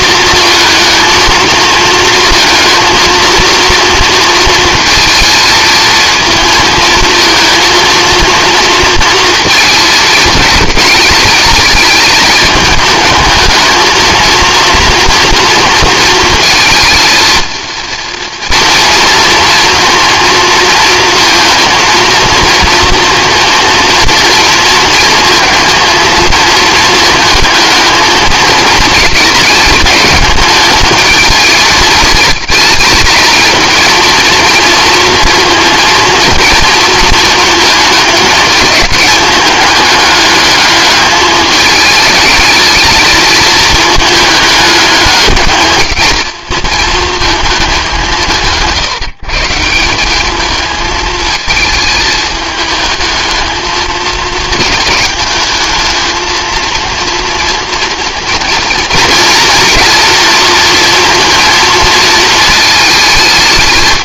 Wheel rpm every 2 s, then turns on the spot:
230, 230, 220, 230, 230, 220, 210, 230, 230, 230, 230, 230, 230, 220, 220, 220, 220, 230, 230, 210, 210, 220, 210, 220, 160, 220, 210, 210, 230, 230, 230, 220.
none